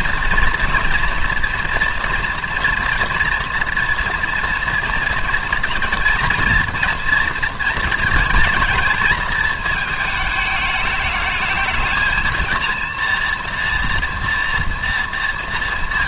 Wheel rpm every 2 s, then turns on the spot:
240, 240, 230, 230, 220, 210, 230, 230.
none